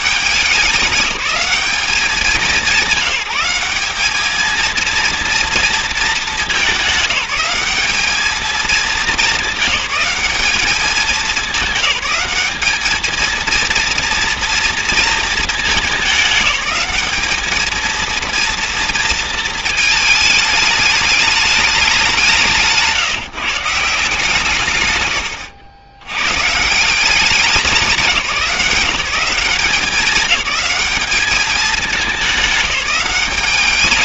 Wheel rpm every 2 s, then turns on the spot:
190, 190, 220, 200, 210, 210, 200, 230, 210, 230, 210, 170, 150, 150, 180, 190, 200.
none